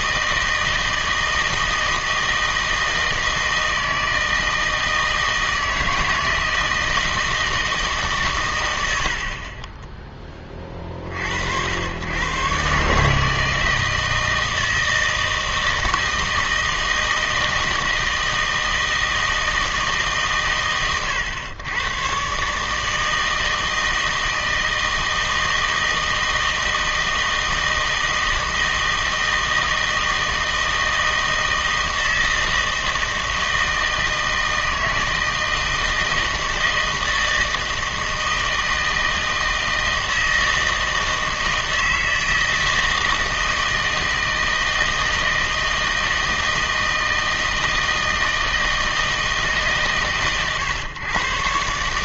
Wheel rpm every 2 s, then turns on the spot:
160, 160, 160, 160, 100, 30, 140, 160, 160, 160, 120, 150, 160, 160, 160, 160, 160, 160, 160, 160, 160, 160, 160, 160, 160, 130.
none